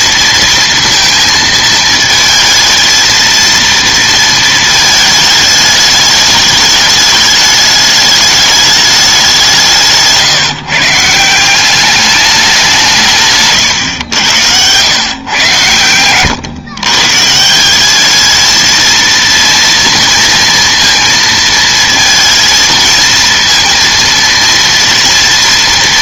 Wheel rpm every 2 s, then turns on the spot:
230, 220, 220, 210, 210, 160, 190, 100, 130, 220, 230, 230, 230.
none